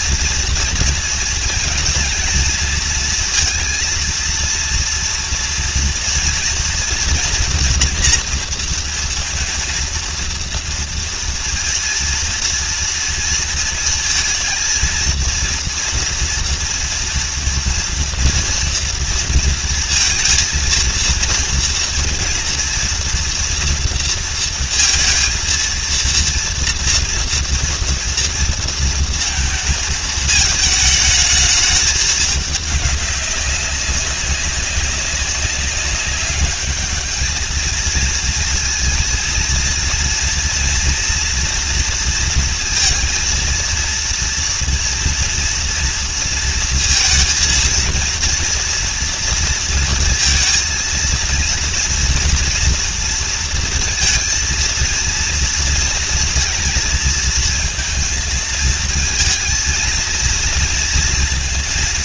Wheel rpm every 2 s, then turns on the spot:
230, 230, 230, 230, 230, 230, 230, 230, 240, 240, 230, 230, 230, 230, 230, 220, 200, 200, 210, 230, 230, 230, 230, 230, 230, 230, 230, 230, 230, 230, 230.
none